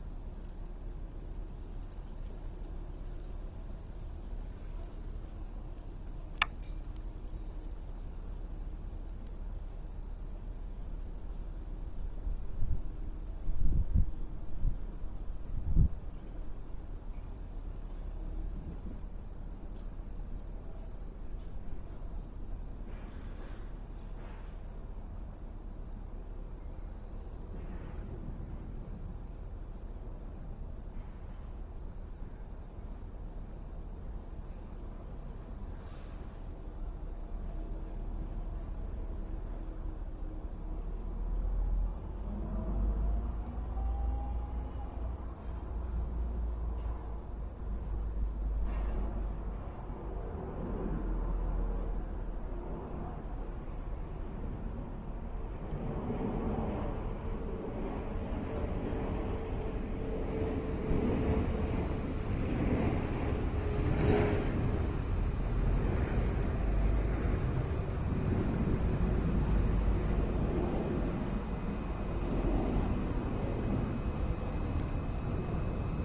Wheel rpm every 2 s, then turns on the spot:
0, 0, 0, 0, 0, 0, 0, 0, 0, 0, 0, 0, 0, 0, 0, 0, 0, 0, 0, 0, 0, 0, 0, 0, 0, 0, 0, 0, 0, 0, 0, 0, 0, 0, 0, 0, 0, 0.
none